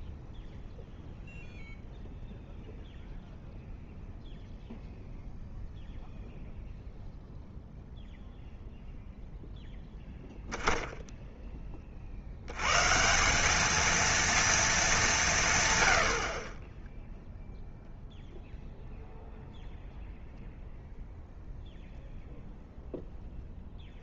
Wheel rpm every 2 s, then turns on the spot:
0, 0, 0, 0, 0, 0, 110, 230, 20, 0, 0, 0.
none